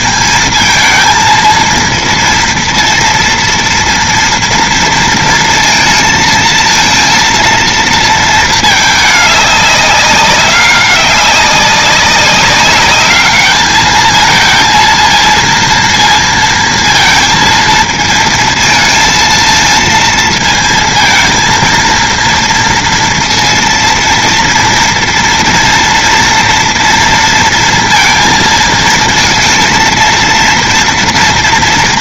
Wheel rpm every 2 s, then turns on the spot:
230, 230, 230, 230, 220, 200, 200, 220, 230, 230, 220, 230, 230, 240, 220, 230.
none